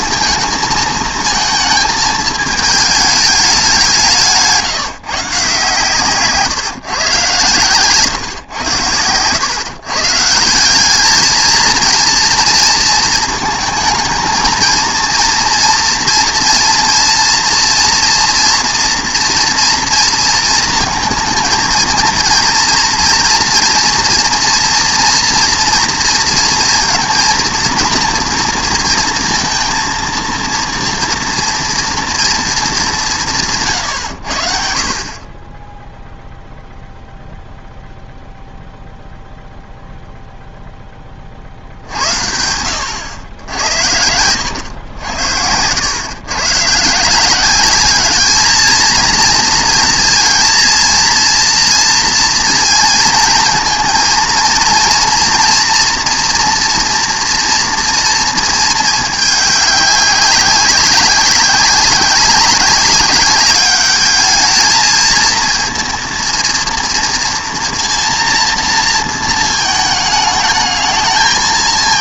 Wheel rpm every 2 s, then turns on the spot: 220, 210, 160, 130, 100, 190, 230, 230, 240, 240, 220, 230, 230, 230, 230, 240, 220, 50, 0, 0, 0, 80, 110, 140, 220, 230, 230, 230, 240, 220, 190, 190, 220, 230, 230, 220.
none